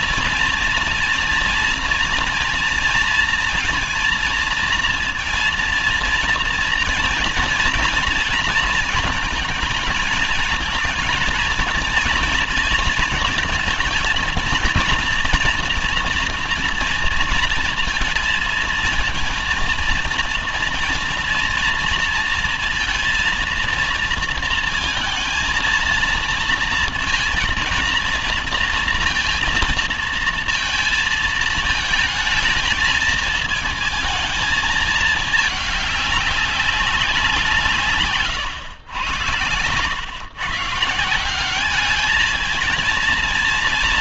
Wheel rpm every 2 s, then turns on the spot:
230, 230, 230, 230, 220, 220, 230, 230, 230, 230, 230, 230, 230, 230, 230, 230, 220, 220, 200, 130, 130, 220.
none